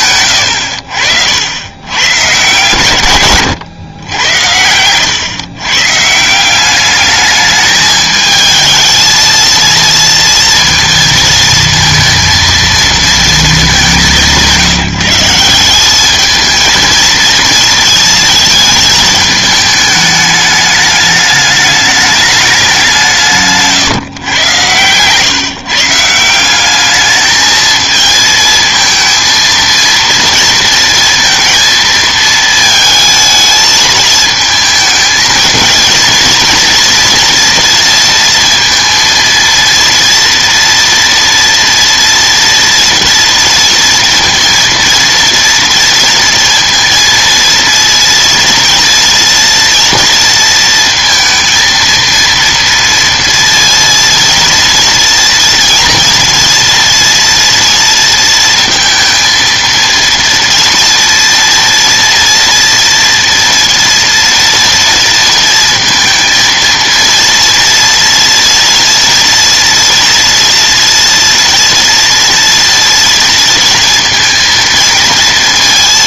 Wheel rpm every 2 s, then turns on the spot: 80, 120, 90, 180, 220, 230, 230, 160, 220, 220, 210, 190, 110, 190, 220, 230, 220, 220, 230, 230, 230, 230, 230, 230, 230, 230, 230, 230, 230, 230, 230, 230, 230, 230, 230, 230, 230, 230.
none